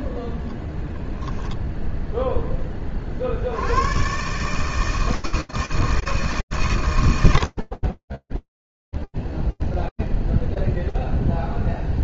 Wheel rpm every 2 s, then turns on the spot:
20, 30, 160, 120, 0, 0.
none